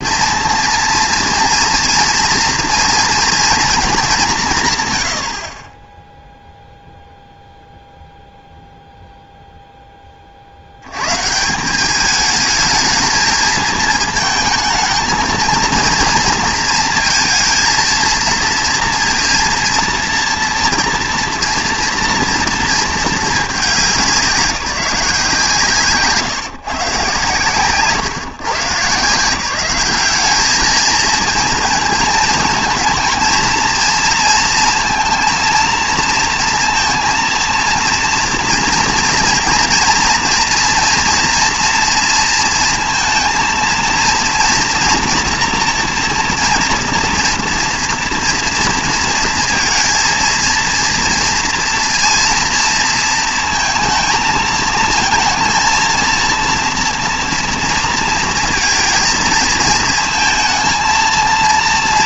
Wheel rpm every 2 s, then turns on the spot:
230, 240, 160, 0, 0, 70, 220, 220, 230, 230, 230, 230, 180, 160, 160, 210, 220, 230, 230, 230, 230, 230, 230, 240, 230, 230, 230, 220, 230, 230, 220.
none